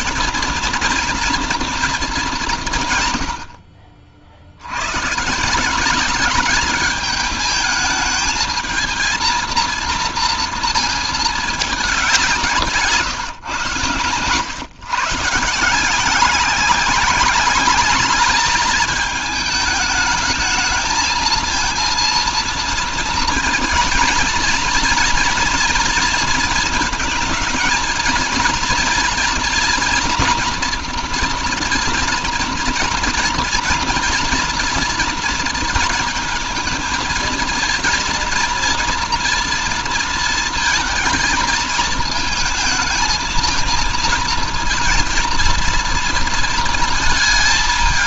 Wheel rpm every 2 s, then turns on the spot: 230, 150, 90, 210, 220, 230, 160, 120, 190, 210, 220, 230, 230, 230, 230, 240, 240, 240, 220, 230, 230, 220, 230, 220.
none